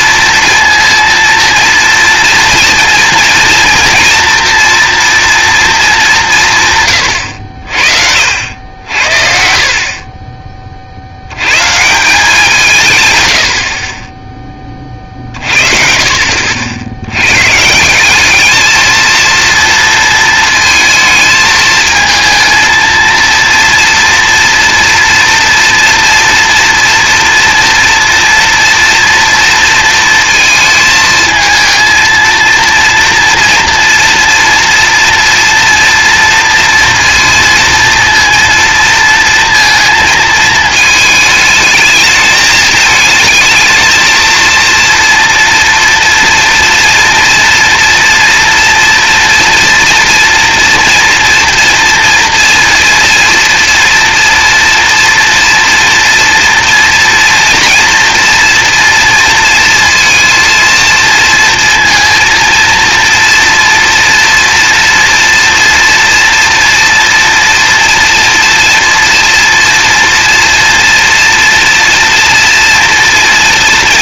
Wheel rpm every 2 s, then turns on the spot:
230, 230, 230, 130, 80, 70, 130, 40, 70, 220, 220, 230, 230, 230, 230, 220, 240, 240, 230, 230, 220, 220, 230, 230, 230, 230, 230, 240, 230, 230, 230, 230, 230, 230, 230, 230, 230.
none